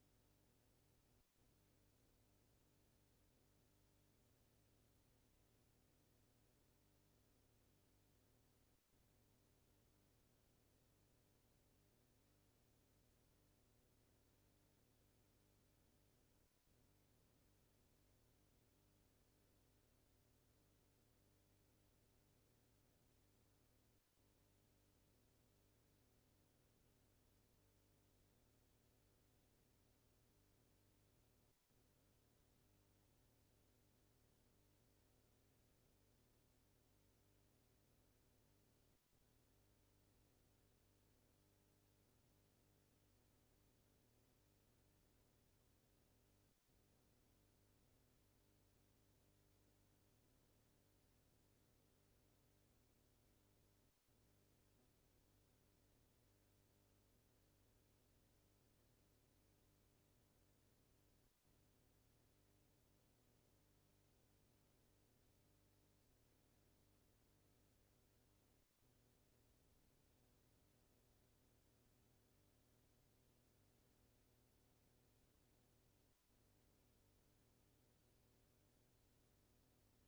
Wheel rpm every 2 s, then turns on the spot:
0, 0, 0, 0, 0, 0, 0, 0, 0, 0, 0, 0, 0, 0, 0, 0, 0, 0, 0, 0, 0, 0, 0, 0, 0, 0, 0, 0, 0, 0, 0, 0, 0, 0, 0, 0, 0, 0, 0, 0.
none